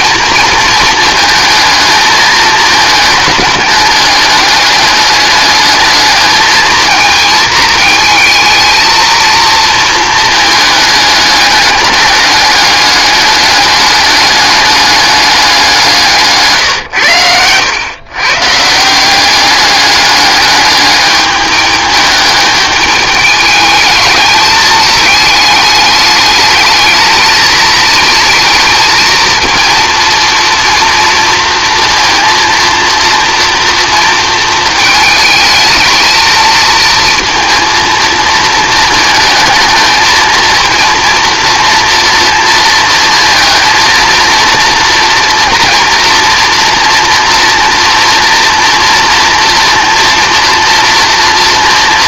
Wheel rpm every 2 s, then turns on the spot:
230, 220, 210, 220, 220, 210, 210, 210, 140, 170, 210, 210, 210, 220, 220, 230, 230, 220, 220, 230, 230, 230, 230, 230, 240, 230.
none